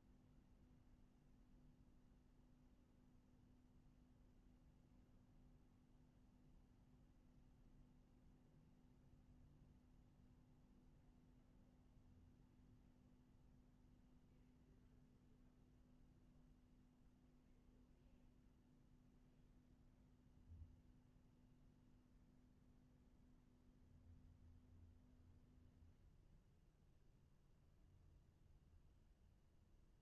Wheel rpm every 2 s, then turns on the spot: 0, 0, 0, 0, 0, 0, 0, 0, 0, 0, 0, 0, 0, 0, 0.
none